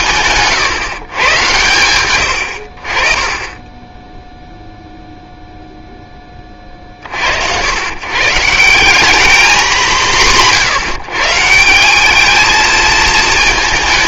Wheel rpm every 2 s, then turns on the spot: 140, 70, 0, 30, 170, 170, 220.
none